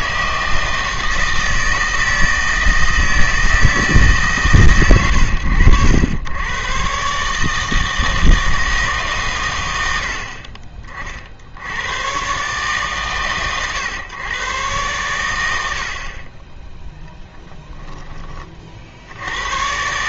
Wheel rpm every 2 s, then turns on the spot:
160, 160, 130, 110, 160, 40, 130, 120, 10, 50.
none